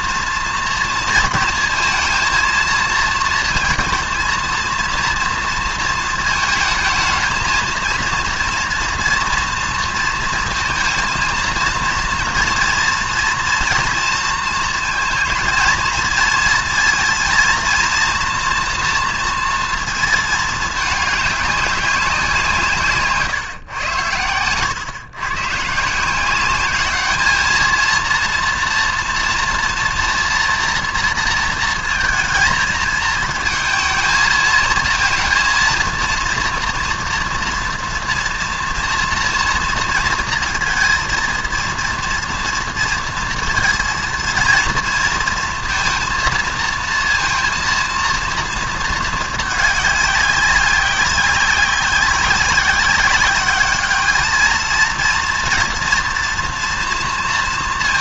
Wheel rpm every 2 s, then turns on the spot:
230, 230, 230, 220, 230, 230, 230, 230, 230, 240, 220, 140, 120, 210, 230, 230, 220, 230, 240, 230, 230, 230, 230, 230, 220, 190, 190, 230, 230.
none